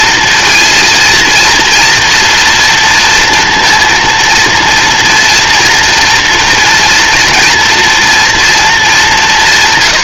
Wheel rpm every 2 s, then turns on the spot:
230, 230, 230, 230, 190.
none